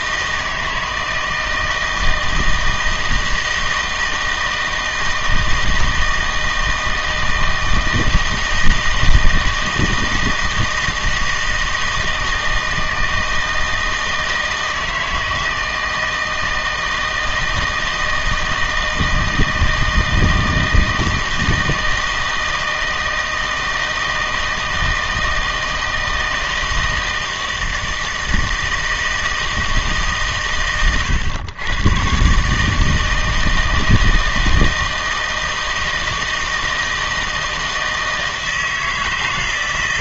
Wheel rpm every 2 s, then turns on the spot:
160, 160, 160, 160, 160, 160, 160, 160, 160, 160, 160, 160, 160, 160, 160, 130, 150, 160, 160, 160.
none